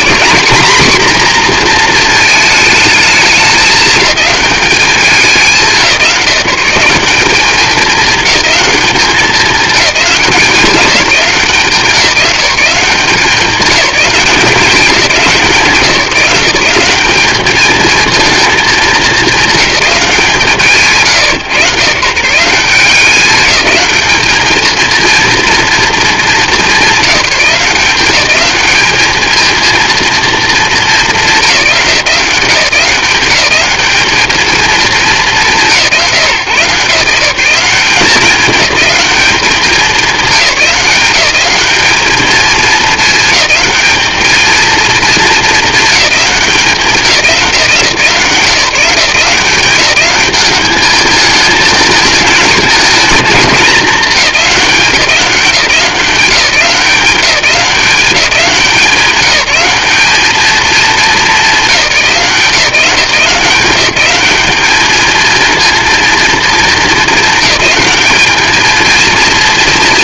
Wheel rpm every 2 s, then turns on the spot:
220, 220, 210, 180, 210, 180, 180, 190, 180, 220, 150, 180, 220, 190, 210, 210, 170, 220, 160, 210, 200, 220, 220, 190, 160, 210, 220, 190, 180, 190, 220, 170, 220, 220, 220.
none